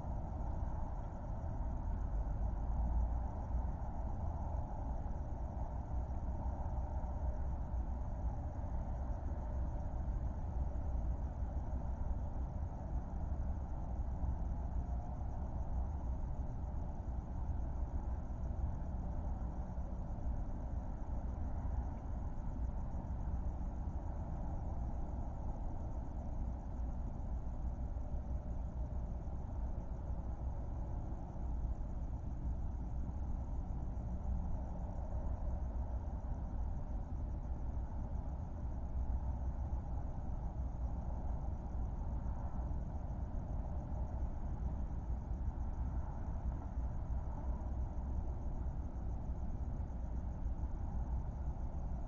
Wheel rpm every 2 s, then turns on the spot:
0, 0, 0, 0, 0, 0, 0, 0, 0, 0, 0, 0, 0, 0, 0, 0, 0, 0, 0, 0, 0, 0, 0, 0, 0, 0.
none